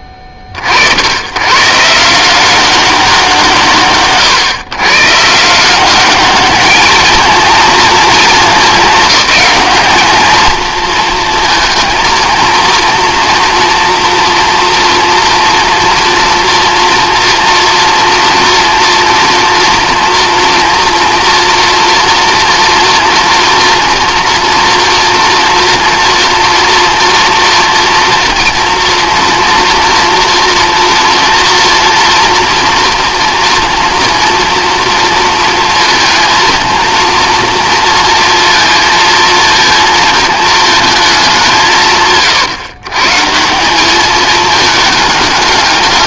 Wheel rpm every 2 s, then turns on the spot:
60, 190, 110, 210, 210, 230, 230, 240, 230, 230, 230, 230, 230, 230, 230, 240, 230, 230, 230, 230, 220, 130, 210.
none